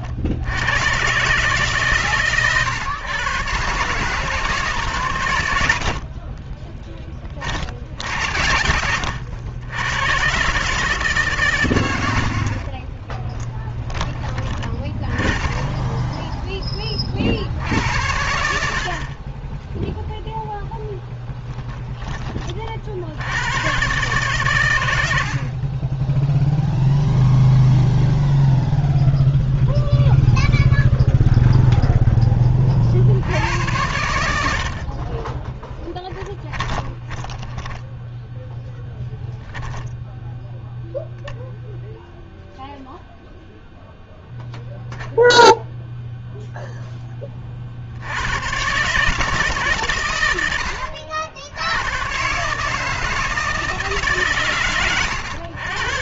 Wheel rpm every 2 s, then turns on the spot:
120, 130, 130, 20, 80, 140, 30, 20, 20, 60, 0, 50, 110, 0, 0, 0, 30, 70, 20, 0, 0, 0, 0, 0, 110, 100, 140, 130.
12-14 36-38